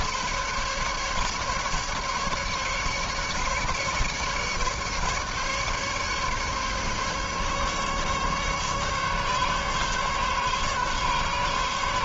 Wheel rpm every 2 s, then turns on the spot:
140, 150, 150, 140, 140, 140.
none